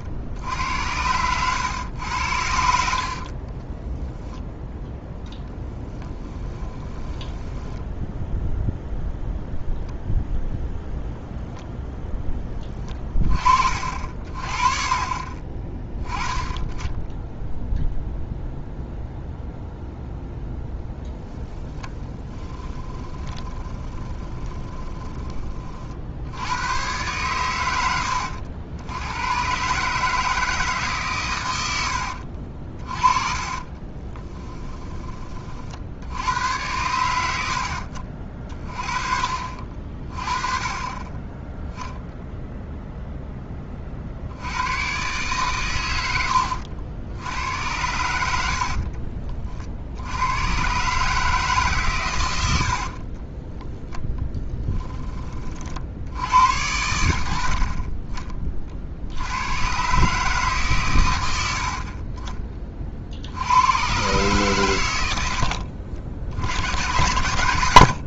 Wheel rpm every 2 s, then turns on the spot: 80, 60, 0, 10, 0, 0, 20, 40, 20, 0, 0, 10, 20, 100, 80, 150, 40, 20, 90, 30, 20, 0, 110, 80, 50, 130, 70, 10, 80, 40, 140, 30, 100, 100.
6-8 22-26 32-36 48-50